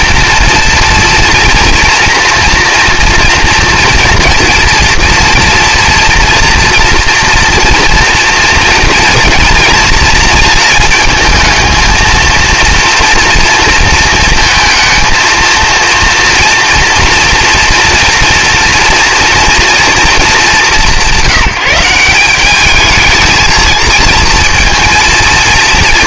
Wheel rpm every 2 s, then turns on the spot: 230, 230, 230, 230, 240, 230, 230, 230, 230, 230, 190, 210, 230.
none